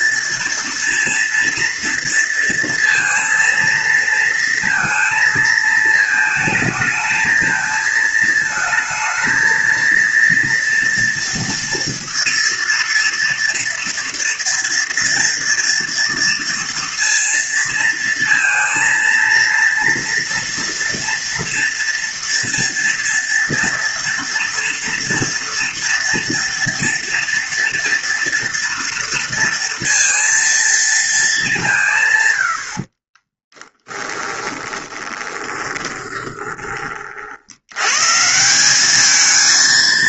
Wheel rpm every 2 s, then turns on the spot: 230, 230, 230, 220, 220, 230, 230, 240, 230, 230, 230, 230, 230, 230, 230, 230, 70, 20, 30, 190.
32-36